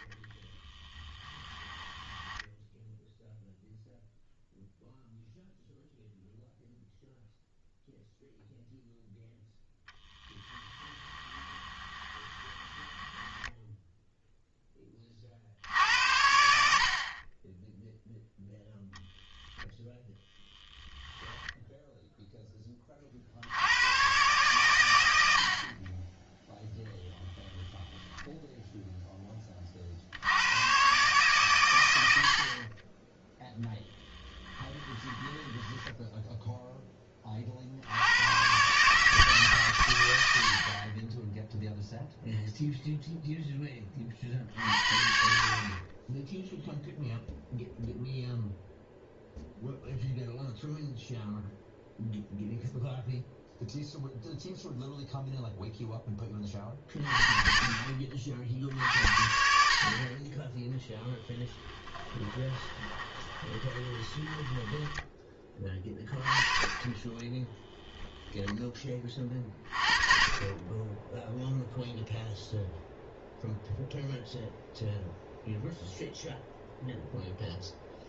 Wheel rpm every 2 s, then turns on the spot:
10, 0, 0, 0, 0, 10, 10, 10, 60, 0, 10, 10, 110, 0, 0, 120, 30, 10, 10, 140, 60, 0, 50, 0, 0, 0, 0, 0, 30, 60, 10, 20, 10, 20, 10, 20, 0, 0, 0.
0-2 10-14 20-22 34-36 60-66